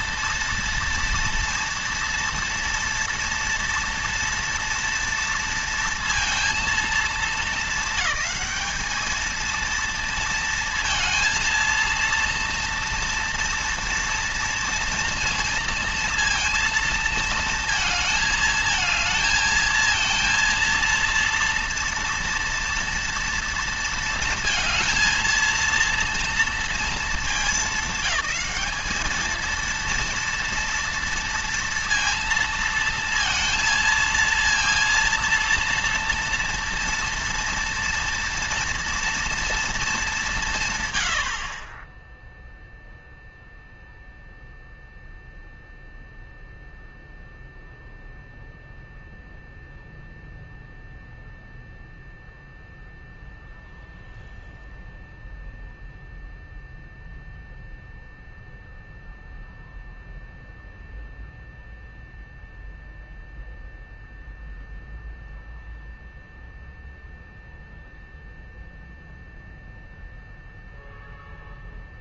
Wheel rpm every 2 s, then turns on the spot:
230, 230, 230, 210, 210, 230, 230, 230, 230, 220, 230, 230, 230, 220, 210, 230, 230, 230, 240, 240, 110, 0, 0, 0, 0, 0, 0, 0, 0, 0, 0, 0, 0, 0, 0, 0.
none